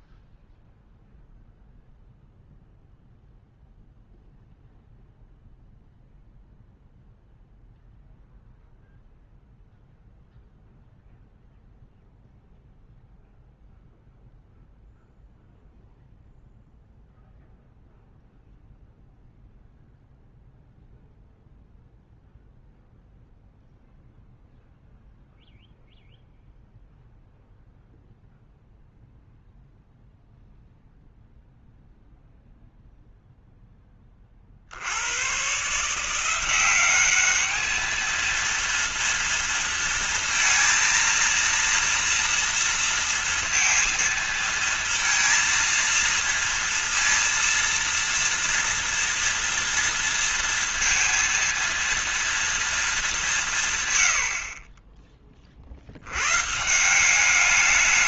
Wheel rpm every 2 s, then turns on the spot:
0, 0, 0, 0, 0, 0, 0, 0, 0, 0, 0, 0, 0, 0, 0, 0, 0, 50, 190, 230, 230, 230, 230, 230, 230, 230, 230, 30, 150.
none